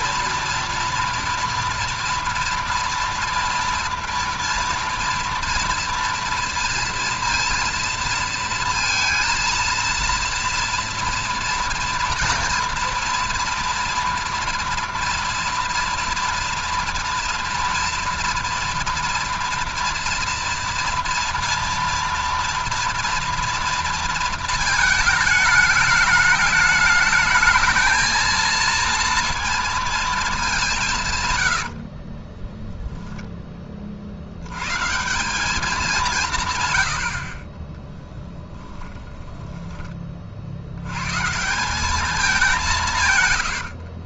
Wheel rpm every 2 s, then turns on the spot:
230, 230, 230, 230, 230, 230, 230, 240, 230, 230, 230, 230, 220, 210, 230, 180, 10, 130, 120, 10, 90, 170.
32-34 38-40